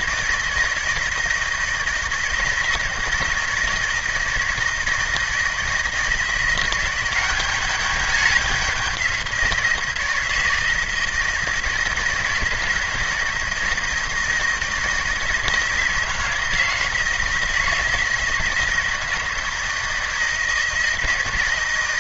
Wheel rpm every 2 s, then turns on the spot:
160, 160, 160, 180, 200, 160, 160, 160, 160, 160, 170.
none